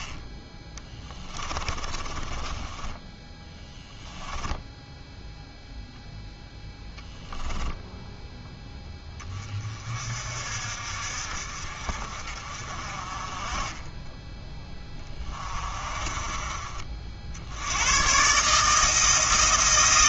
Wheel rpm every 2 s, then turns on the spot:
10, 10, 10, 10, 10, 50, 40, 10, 40, 160.
0-6